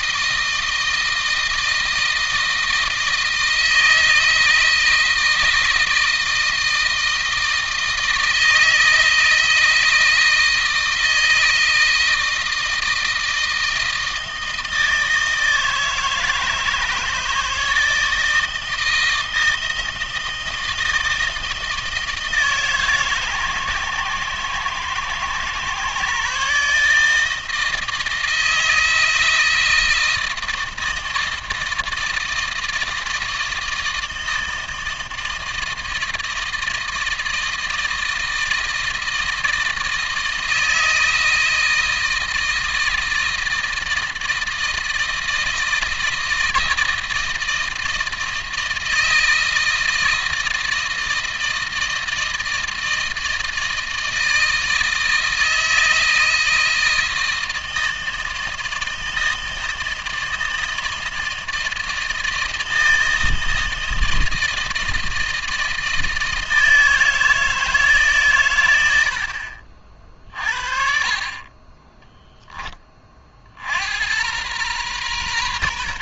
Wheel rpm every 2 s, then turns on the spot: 160, 160, 160, 160, 160, 160, 160, 160, 160, 160, 160, 150, 120, 150, 160, 160, 160, 160, 160, 160, 160, 160, 160, 160, 160, 160, 160, 160, 160, 160, 160, 160, 160, 160, 100, 40, 20, 120.
none